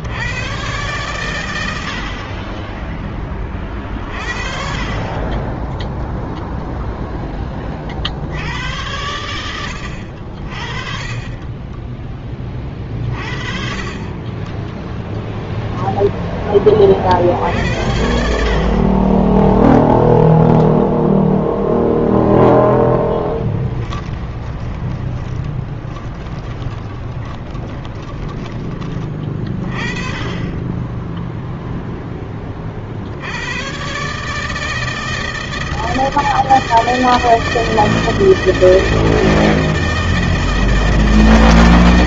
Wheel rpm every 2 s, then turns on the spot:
100, 20, 20, 10, 90, 20, 30, 0, 60, 20, 10, 10, 20, 20, 30, 10, 90, 160, 160, 160, 160.
22-28 30-32